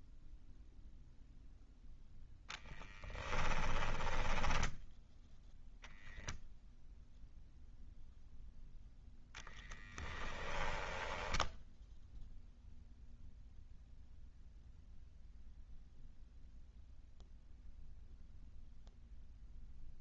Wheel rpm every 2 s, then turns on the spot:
0, 10, 0, 0, 0, 10, 0, 0, 0, 0.
2-4 10-12